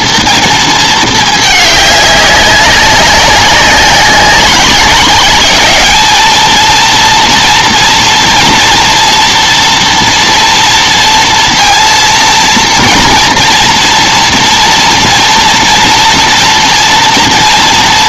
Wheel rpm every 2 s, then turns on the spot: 230, 200, 200, 220, 230, 230, 230, 230, 230.
none